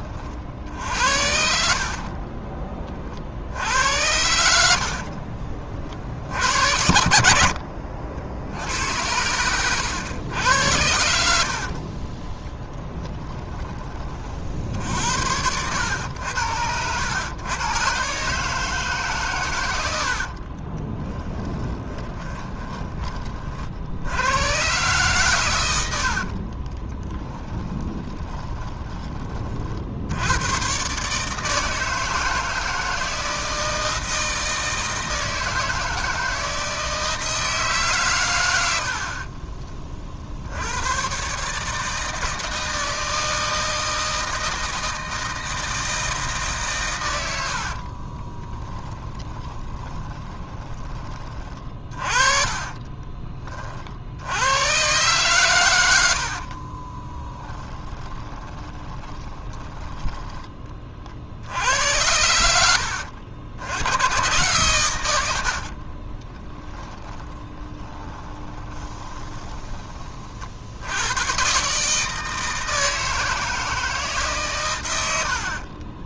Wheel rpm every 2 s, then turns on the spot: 60, 30, 70, 70, 80, 100, 10, 60, 100, 150, 30, 20, 120, 30, 20, 120, 160, 160, 160, 90, 90, 160, 160, 140, 10, 20, 30, 120, 40, 20, 20, 80, 120, 10, 20, 60, 160, 140.
12-14 20-24 26-30 48-54 56-60 66-70